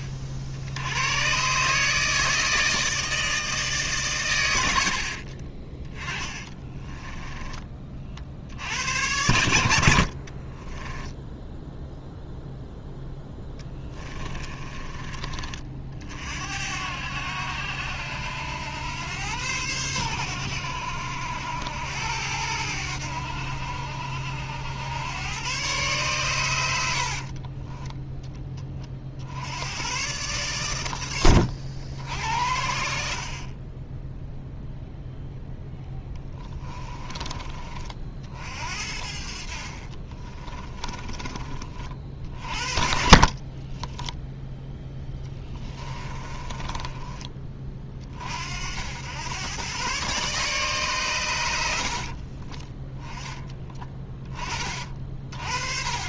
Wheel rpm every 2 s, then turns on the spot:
60, 160, 90, 20, 80, 20, 0, 30, 70, 100, 90, 90, 90, 90, 30, 120, 70, 0, 20, 60, 30, 50, 0, 20, 80, 140, 20, 30.
4-8 10-12 14-16 32-34 36-38 40-42 46-48 54-56